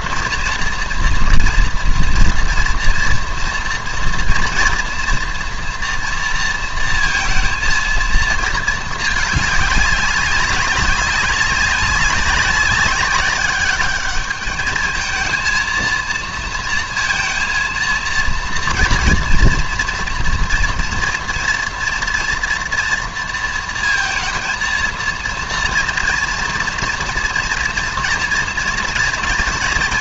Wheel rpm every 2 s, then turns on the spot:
230, 230, 230, 230, 220, 190, 200, 220, 230, 240, 240, 230, 230, 230, 230.
none